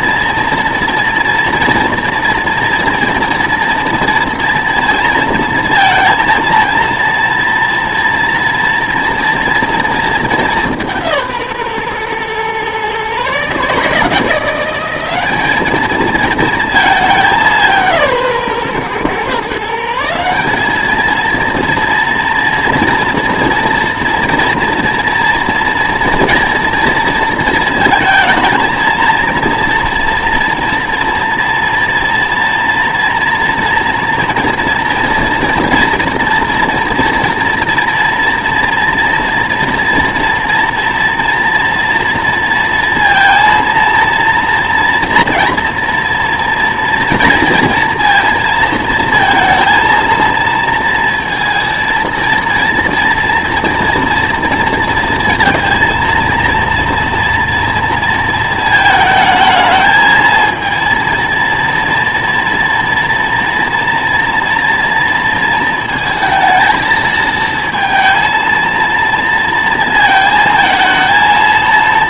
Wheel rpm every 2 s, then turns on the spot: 230, 230, 230, 230, 240, 190, 130, 180, 220, 140, 200, 230, 230, 240, 230, 230, 230, 230, 230, 230, 230, 230, 240, 230, 230, 230, 230, 230, 230, 220, 230, 230, 230, 220, 230, 220.
none